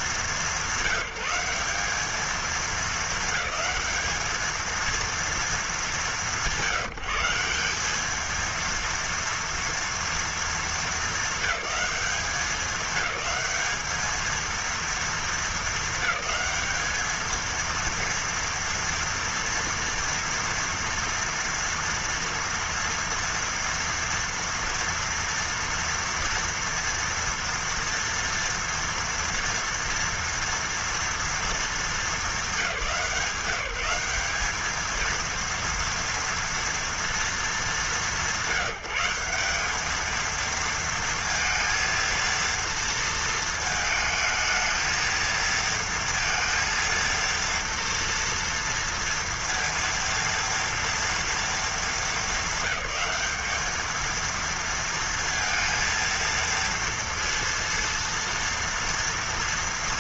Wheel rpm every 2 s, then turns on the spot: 210, 220, 220, 190, 220, 220, 190, 220, 200, 230, 230, 230, 230, 230, 230, 230, 200, 200, 230, 170, 220, 230, 220, 230, 230, 230, 220, 230, 230, 230.
none